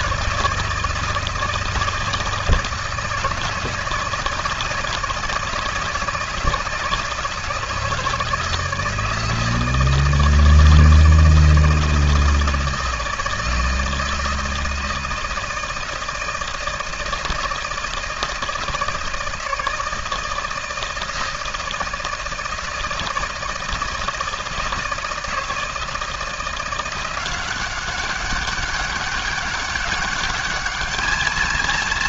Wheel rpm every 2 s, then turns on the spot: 160, 160, 160, 160, 160, 160, 160, 160, 160, 160, 160, 160, 160, 170, 200, 210.
none